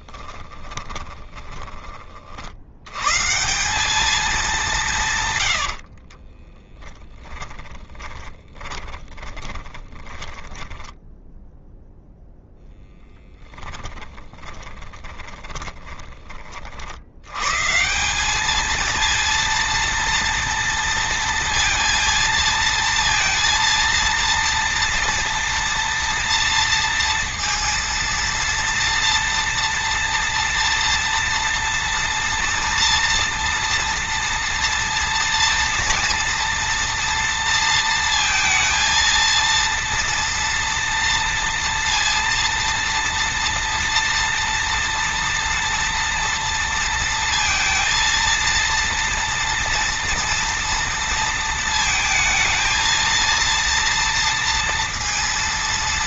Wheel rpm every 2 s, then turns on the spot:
20, 60, 190, 20, 20, 20, 0, 20, 60, 210, 230, 230, 230, 230, 230, 230, 230, 230, 230, 230, 230, 230, 230, 230, 230, 230, 220, 230.
0-2 6-12 14-16